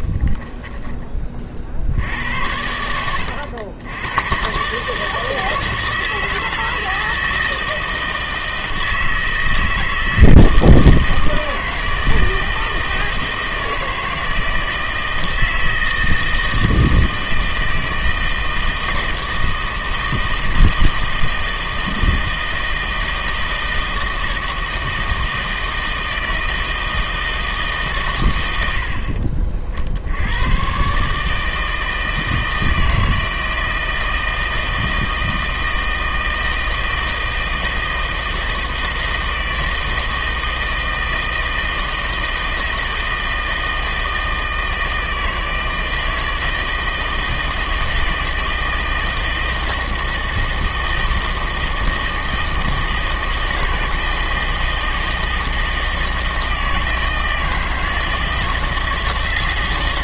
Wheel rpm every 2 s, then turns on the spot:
10, 80, 140, 160, 160, 160, 160, 160, 160, 160, 160, 160, 160, 160, 70, 130, 160, 160, 160, 160, 160, 160, 160, 160, 160, 160, 160, 160, 160, 160.
none